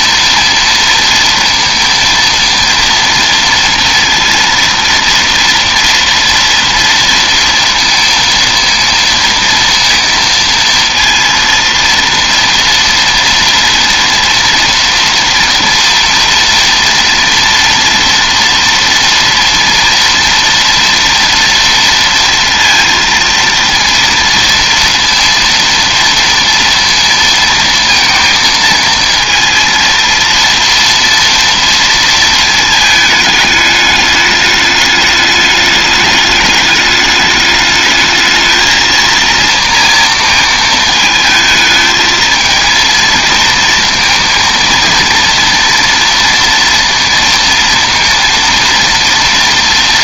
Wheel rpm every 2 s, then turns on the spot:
230, 230, 230, 230, 230, 230, 230, 230, 230, 230, 230, 230, 230, 230, 230, 230, 220, 210, 210, 220, 220, 230, 230, 230, 230.
none